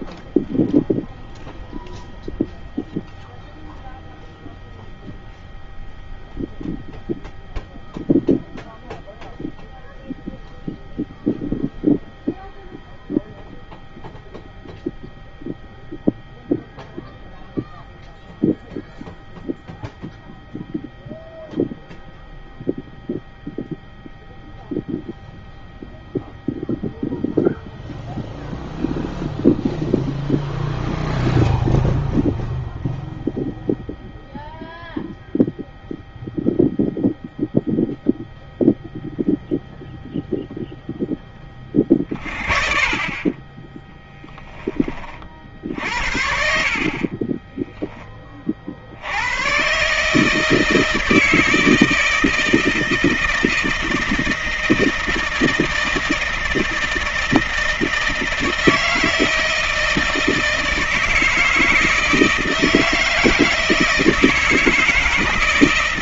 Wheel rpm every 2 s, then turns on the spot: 0, 0, 0, 0, 0, 0, 0, 0, 0, 0, 0, 0, 0, 0, 0, 0, 0, 0, 0, 0, 10, 30, 40, 40, 80, 160, 160, 160, 160, 160, 160, 160, 160.
none